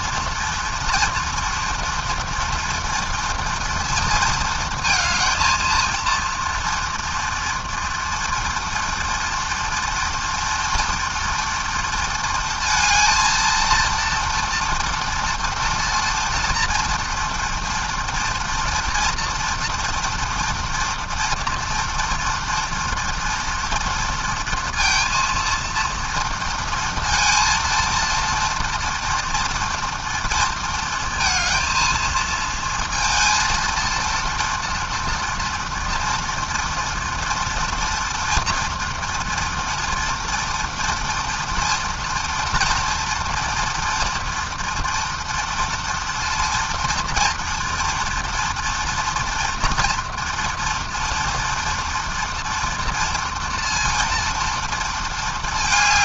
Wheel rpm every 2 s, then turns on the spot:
230, 230, 230, 240, 230, 230, 220, 230, 230, 230, 230, 240, 230, 230, 230, 230, 230, 230, 230, 230, 230, 230, 230, 240, 230, 230, 230, 220.
none